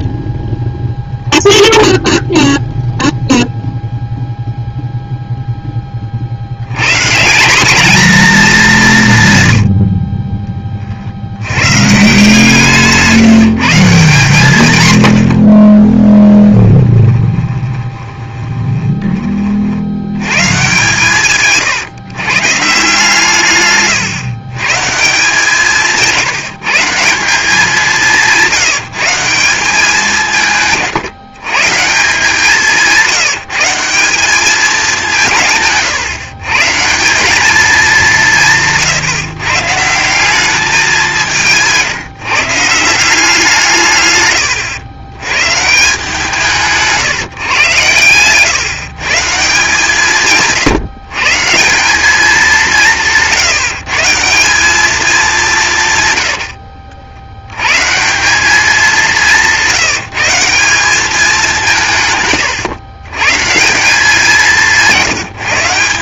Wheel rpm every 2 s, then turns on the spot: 0, 0, 0, 140, 160, 60, 160, 90, 20, 20, 150, 150, 150, 170, 180, 140, 180, 170, 170, 150, 190, 170, 100, 150, 160, 140, 170, 210, 50, 200, 200, 100, 170.
14-18 64-66